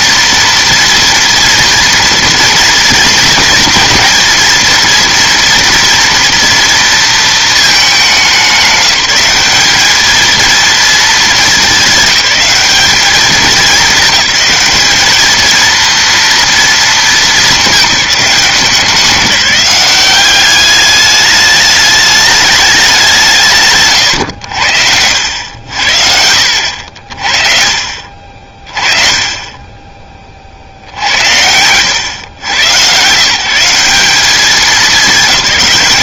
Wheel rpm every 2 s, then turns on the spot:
230, 240, 230, 230, 200, 220, 210, 210, 230, 170, 190, 210, 90, 70, 40, 50, 110, 200.
none